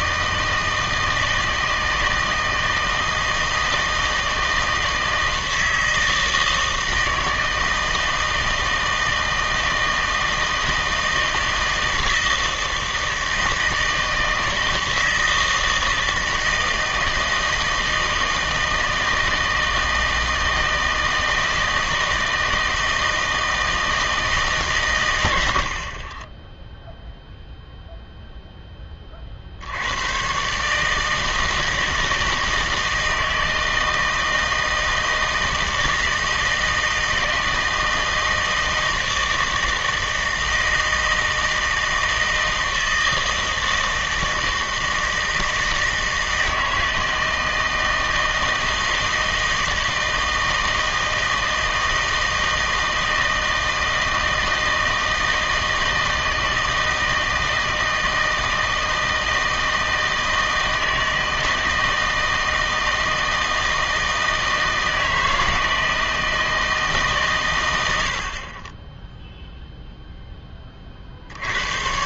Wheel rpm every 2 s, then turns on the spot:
160, 160, 160, 160, 160, 160, 160, 160, 160, 160, 160, 160, 140, 0, 10, 140, 160, 160, 160, 160, 160, 160, 160, 160, 160, 160, 160, 160, 160, 160, 160, 160, 160, 160, 30, 10.
none